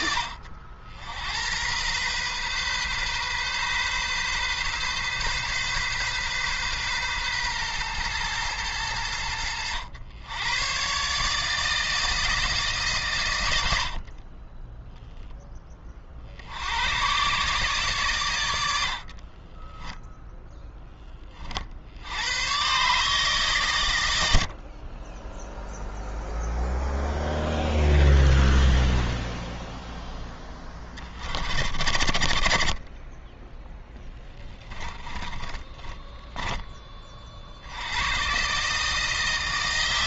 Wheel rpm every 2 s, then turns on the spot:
70, 130, 130, 130, 100, 130, 140, 10, 100, 60, 10, 140, 30, 0, 20, 20, 10, 30, 30, 150.
18-20 28-30 34-36